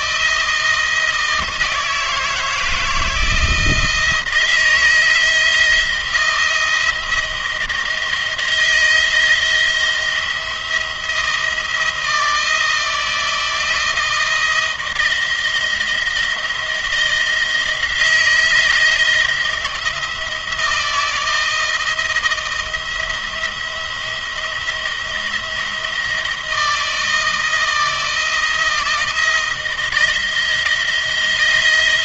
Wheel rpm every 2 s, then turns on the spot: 160, 160, 160, 170, 170, 170, 160, 170, 170, 160, 160, 170, 170, 160, 160, 170.
none